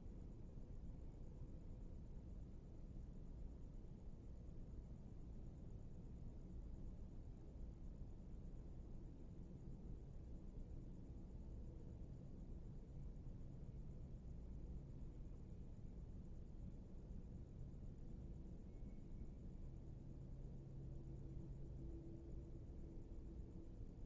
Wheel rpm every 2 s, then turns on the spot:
0, 0, 0, 0, 0, 0, 0, 0, 0, 0, 0, 0.
none